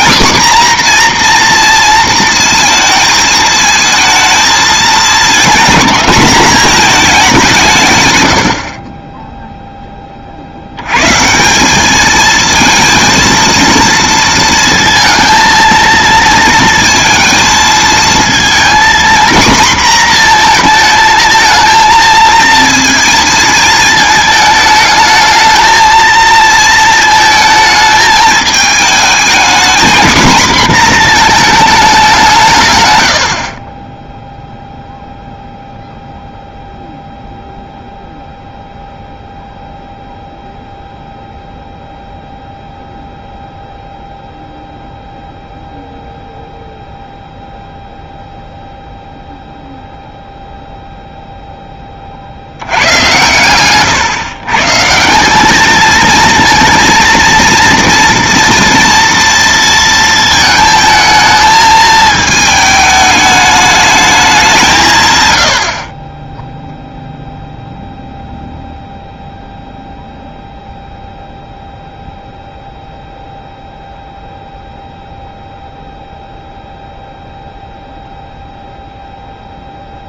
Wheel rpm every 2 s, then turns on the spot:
250, 230, 230, 210, 30, 110, 230, 230, 230, 240, 230, 230, 220, 220, 220, 230, 120, 0, 0, 0, 0, 0, 0, 0, 0, 0, 100, 160, 230, 230, 220, 210, 150, 0, 0, 0, 0, 0, 0, 0.
8-10